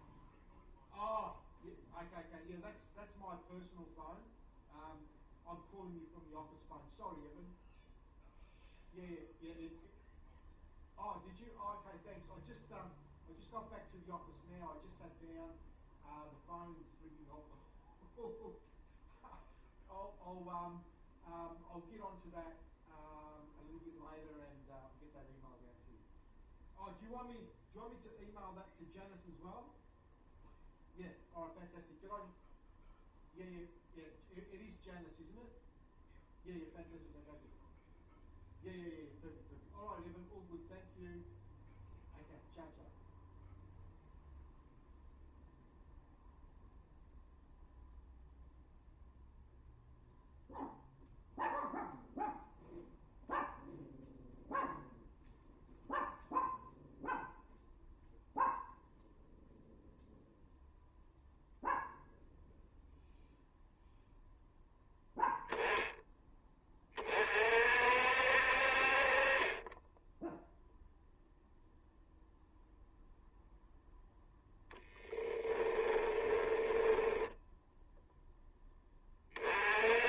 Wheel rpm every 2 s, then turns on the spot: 0, 0, 0, 0, 0, 0, 0, 0, 0, 0, 0, 0, 0, 0, 0, 0, 0, 0, 0, 0, 0, 0, 0, 0, 0, 0, 0, 0, 0, 0, 0, 0, 0, 20, 50, 0, 0, 10, 10, 20.
74-78